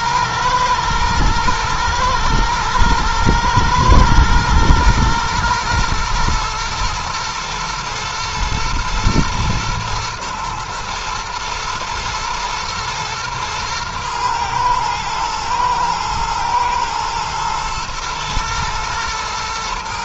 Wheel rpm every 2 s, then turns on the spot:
110, 120, 120, 120, 120, 110, 110, 110, 110, 110.
none